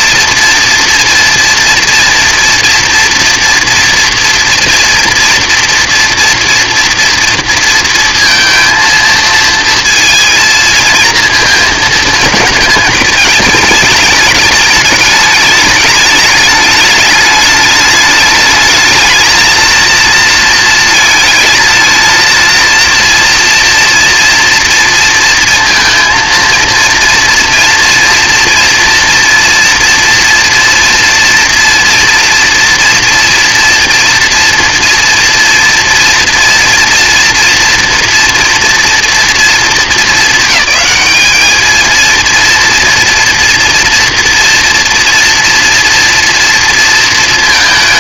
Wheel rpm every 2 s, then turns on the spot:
230, 230, 230, 230, 230, 230, 220, 210, 210, 210, 230, 230, 230, 230, 240, 230, 230, 230, 230, 230, 220, 230, 230, 230.
none